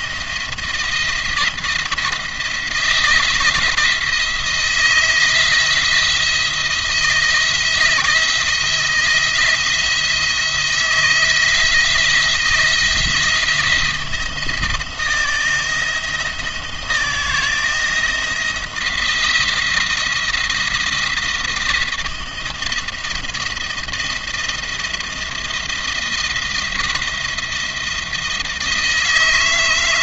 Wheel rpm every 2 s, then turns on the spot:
170, 160, 160, 170, 170, 160, 160, 170, 170, 170, 170, 170, 170, 170, 160.
none